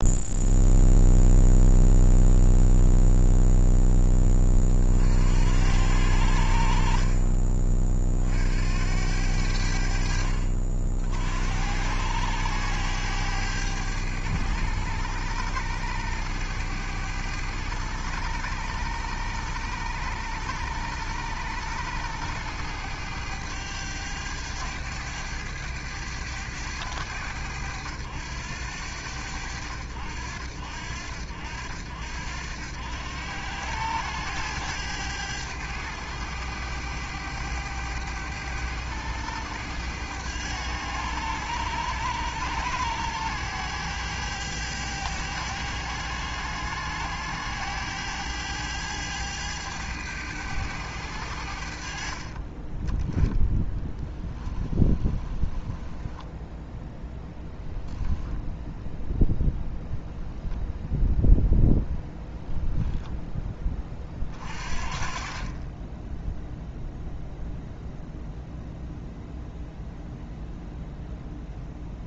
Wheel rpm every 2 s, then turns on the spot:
0, 0, 50, 50, 80, 60, 100, 100, 100, 100, 100, 100, 100, 100, 90, 70, 90, 100, 100, 100, 100, 100, 100, 100, 100, 90, 20, 20, 0, 0, 0, 0, 40, 0, 0, 0.
52-56